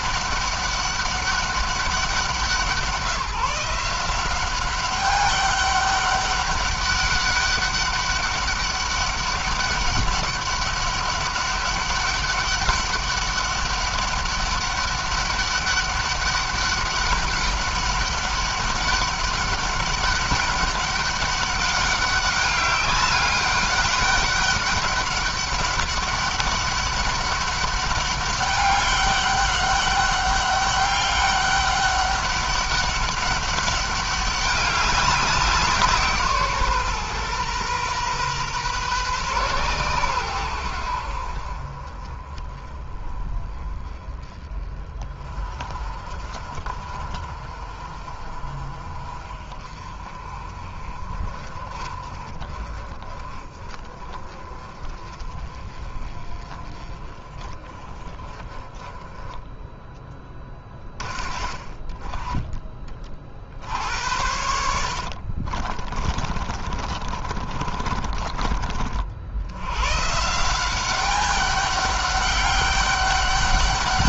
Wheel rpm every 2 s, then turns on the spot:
200, 170, 190, 200, 200, 200, 200, 200, 200, 200, 200, 200, 200, 200, 200, 200, 200, 190, 140, 130, 80, 20, 30, 40, 40, 40, 30, 30, 30, 20, 30, 30, 70, 30, 50, 190, 200.
64-68